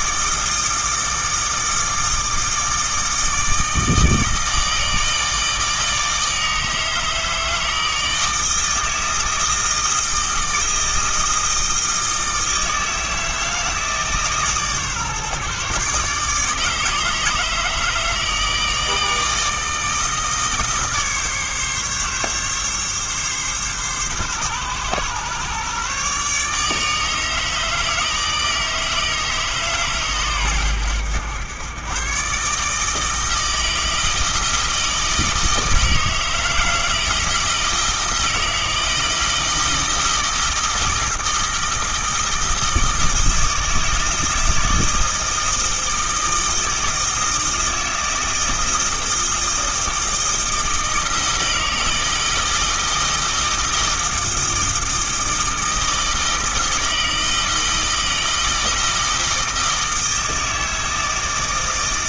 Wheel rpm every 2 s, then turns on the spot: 160, 160, 160, 160, 160, 160, 160, 140, 160, 160, 150, 140, 120, 150, 160, 100, 150, 160, 160, 160, 160, 160, 160, 160, 160, 160, 160, 160, 160, 160, 160.
none